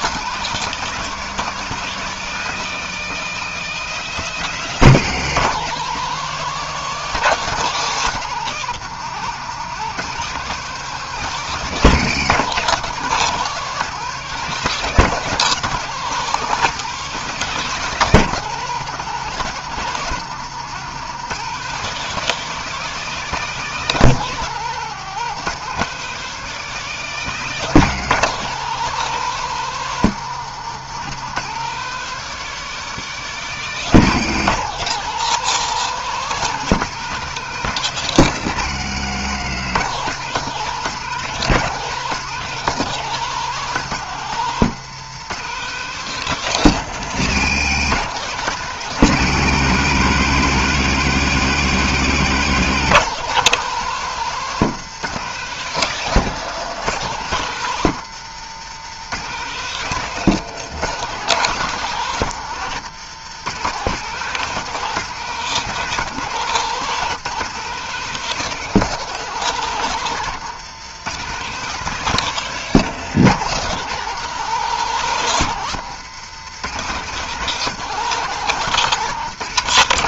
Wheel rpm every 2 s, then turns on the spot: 200, 200, 180, 190, 170, 180, 170, 190, 190, 170, 170, 190, 170, 180, 180, 170, 180, 180, 180, 140, 170, 180, 170, 150, 160, 170, 180, 180, 160, 160, 170, 150, 170, 170, 180, 170, 170, 160, 170, 180.
none